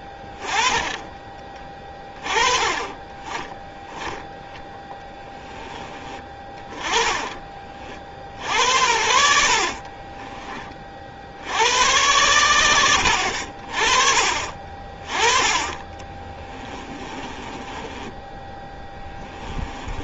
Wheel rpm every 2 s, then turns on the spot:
20, 20, 20, 20, 70, 30, 90, 40, 20, 10.
0-2 4-6 8-10 16-20